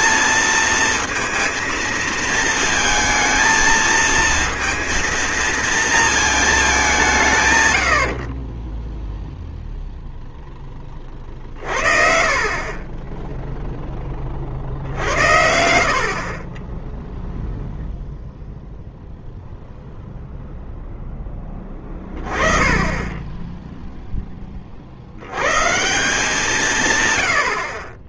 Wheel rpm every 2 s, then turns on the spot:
230, 220, 230, 150, 0, 20, 20, 60, 0, 0, 0, 20, 60, 110.
none